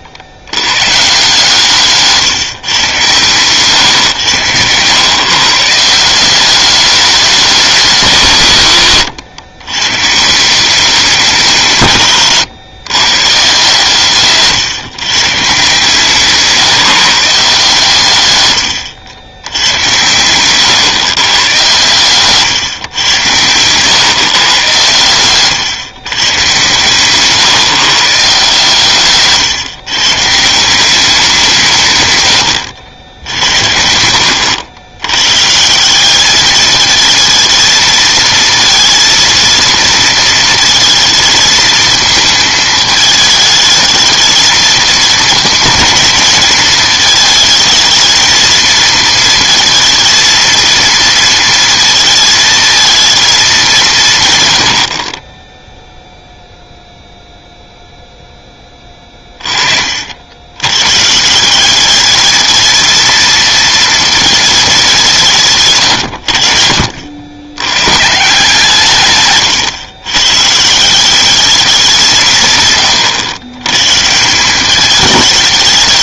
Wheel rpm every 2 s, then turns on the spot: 110, 140, 110, 200, 140, 170, 120, 140, 160, 110, 120, 140, 120, 130, 150, 170, 80, 90, 210, 230, 220, 220, 220, 220, 220, 230, 220, 110, 0, 10, 110, 220, 210, 60, 150, 140, 150, 190.
4-6 18-22